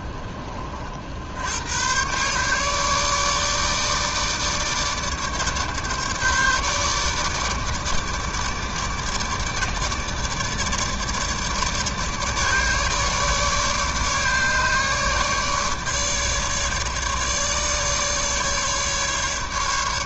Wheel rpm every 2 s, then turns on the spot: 60, 150, 150, 150, 150, 150, 150, 150, 150, 150.
none